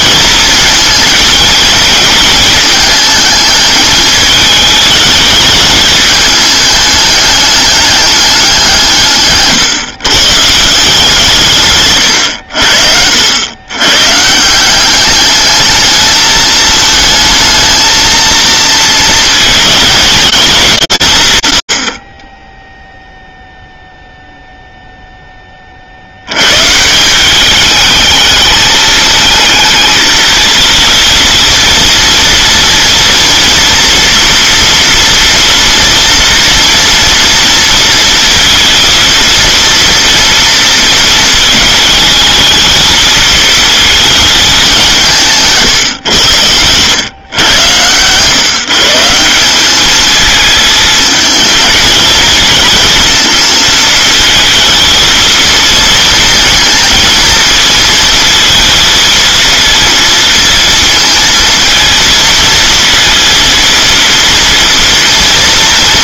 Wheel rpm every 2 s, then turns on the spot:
220, 220, 210, 210, 170, 170, 70, 180, 220, 220, 180, 0, 0, 160, 220, 230, 240, 230, 240, 230, 230, 220, 180, 120, 170, 220, 220, 220, 220, 220, 230, 230, 230.
none